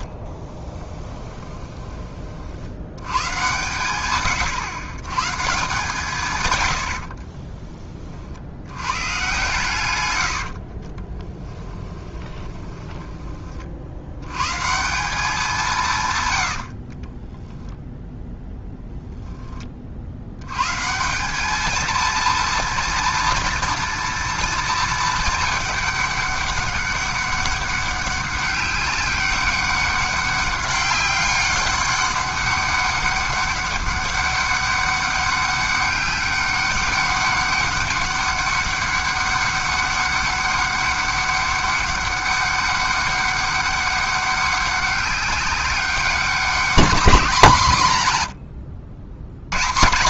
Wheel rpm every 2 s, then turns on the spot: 30, 90, 110, 90, 90, 40, 20, 160, 60, 0, 140, 230, 220, 200, 200, 200, 200, 200, 200, 200, 200, 200, 200, 200, 80.
0-2 10-14 16-18